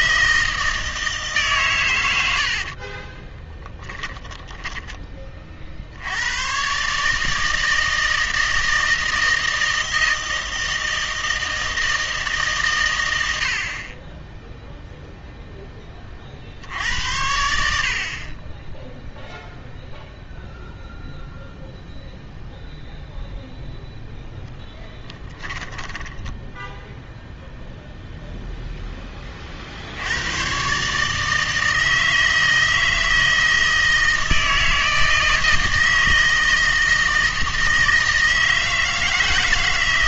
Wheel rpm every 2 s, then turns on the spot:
160, 50, 10, 130, 160, 160, 130, 0, 70, 10, 0, 0, 10, 10, 0, 120, 160, 160, 160, 160.
2-4 24-28